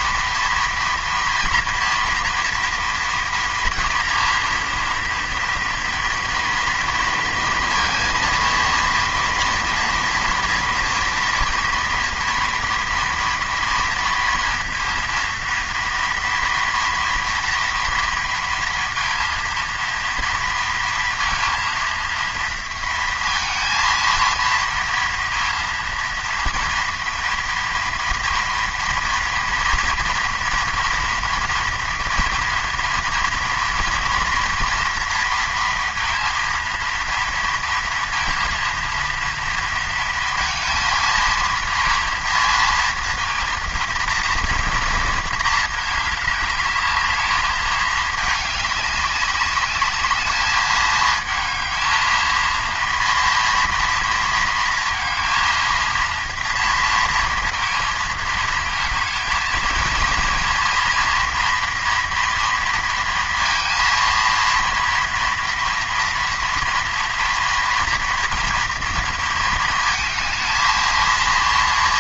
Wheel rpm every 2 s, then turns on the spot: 240, 230, 230, 230, 230, 230, 230, 230, 230, 230, 230, 230, 230, 230, 230, 230, 230, 230, 230, 230, 230, 230, 230, 210, 200, 220, 230, 230, 230, 220, 230, 230, 230, 230, 230, 230.
none